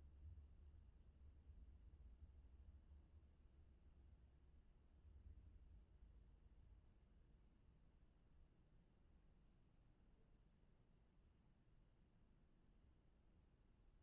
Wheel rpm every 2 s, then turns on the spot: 0, 0, 0, 0, 0, 0, 0.
none